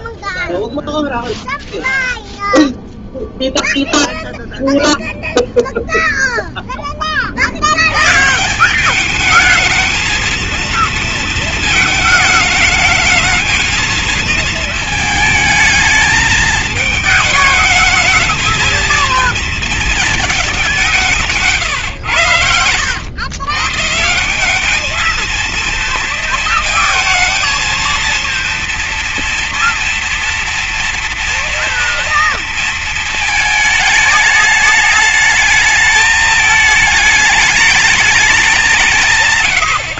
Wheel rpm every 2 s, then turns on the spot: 0, 0, 0, 20, 190, 230, 220, 220, 220, 220, 170, 100, 220, 230, 230, 230, 230, 210, 210, 170.
none